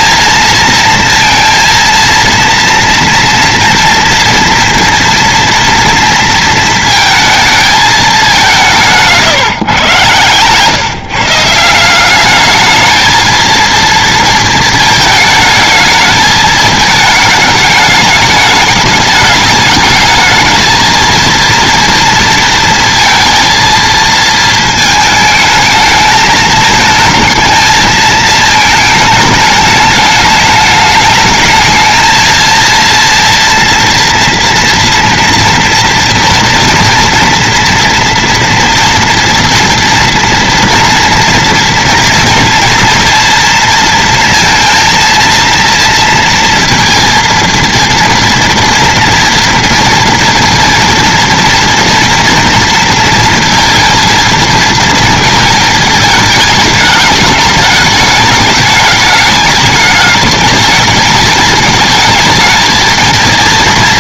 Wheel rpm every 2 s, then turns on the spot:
230, 230, 230, 220, 190, 140, 220, 220, 220, 210, 220, 230, 220, 220, 220, 210, 230, 230, 230, 230, 230, 230, 230, 230, 230, 230, 230, 230, 210, 210, 220, 220.
none